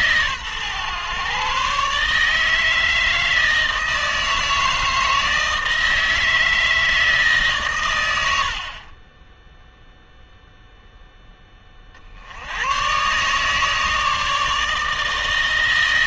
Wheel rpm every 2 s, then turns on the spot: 130, 160, 160, 160, 50, 0, 110, 160.
none